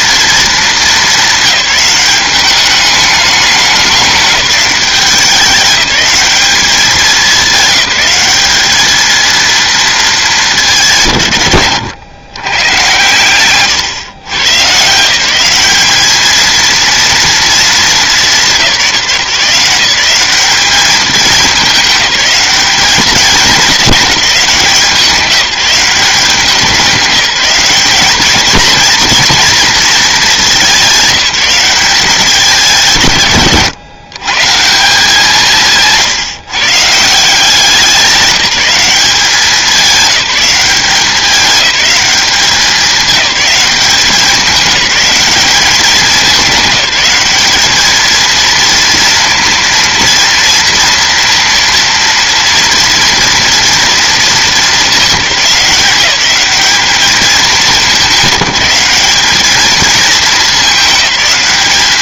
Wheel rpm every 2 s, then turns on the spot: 220, 210, 190, 200, 210, 170, 130, 150, 230, 170, 210, 210, 190, 190, 220, 190, 170, 170, 150, 190, 190, 200, 200, 200, 230, 230, 230, 210, 210, 200, 210.
none